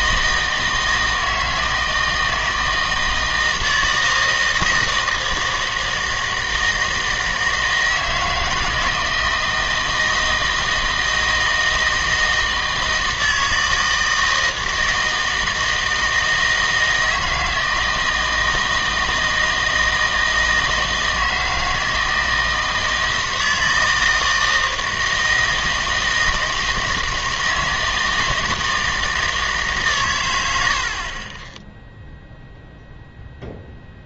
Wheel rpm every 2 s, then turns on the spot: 160, 160, 160, 160, 160, 160, 160, 160, 160, 160, 160, 160, 160, 160, 160, 80, 0.
none